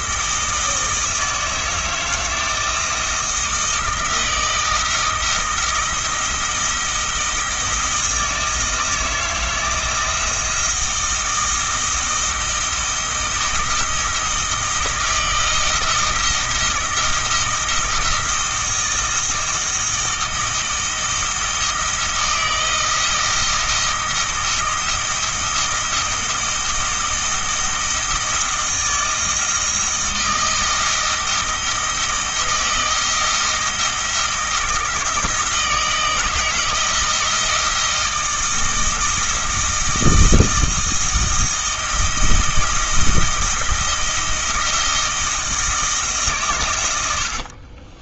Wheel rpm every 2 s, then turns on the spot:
160, 160, 160, 160, 160, 170, 160, 160, 160, 160, 160, 170, 170, 160, 160, 160, 160, 160, 160, 160, 160, 160, 160, 110.
none